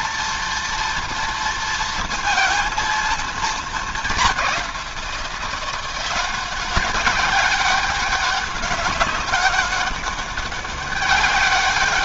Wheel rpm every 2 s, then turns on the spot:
230, 230, 190, 190, 200, 200.
none